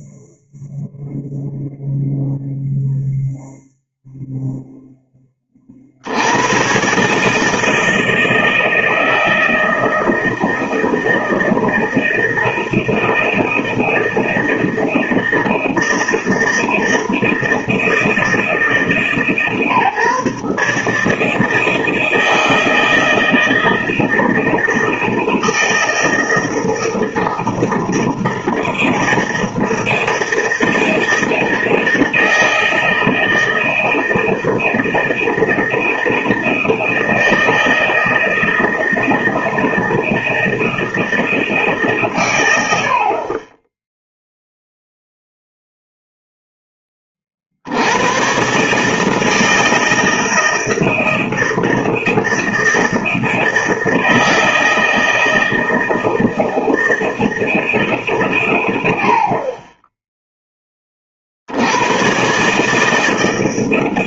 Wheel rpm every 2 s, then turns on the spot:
0, 0, 0, 130, 160, 160, 160, 160, 160, 150, 150, 160, 160, 160, 160, 160, 160, 160, 160, 160, 160, 70, 0, 20, 150, 160, 160, 160, 160, 110, 20, 150.
none